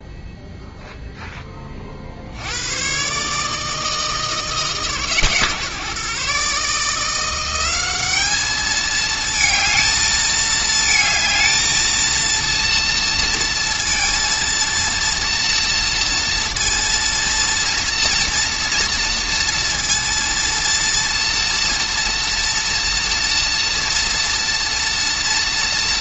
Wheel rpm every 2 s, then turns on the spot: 0, 110, 150, 160, 220, 220, 230, 230, 230, 230, 230, 230, 230.
none